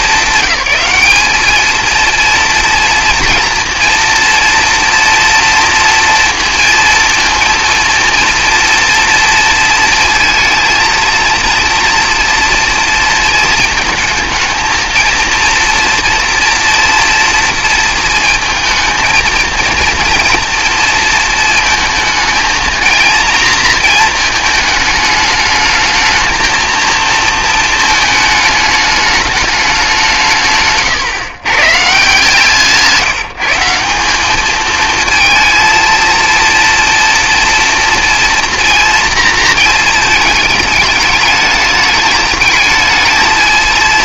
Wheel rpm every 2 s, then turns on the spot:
200, 230, 240, 230, 230, 230, 230, 220, 230, 230, 230, 230, 220, 230, 210, 130, 160, 220, 230, 230, 210, 220.
30-32